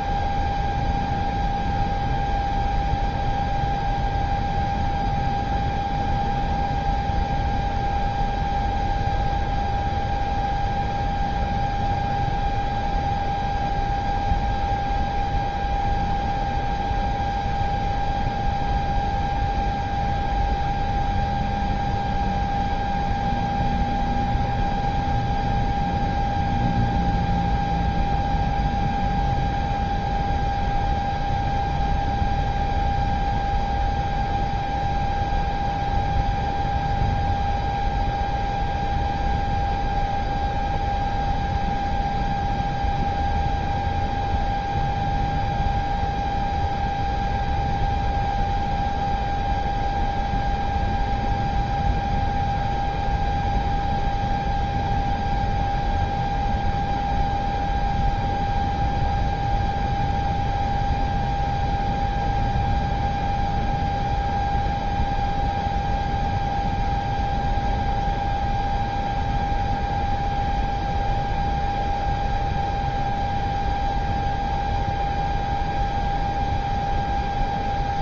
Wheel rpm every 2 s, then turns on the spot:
0, 0, 0, 0, 0, 0, 0, 0, 0, 0, 0, 0, 0, 0, 0, 0, 0, 0, 0, 0, 0, 0, 0, 0, 0, 0, 0, 0, 0, 0, 0, 0, 0, 0, 0, 0, 0, 0, 0.
none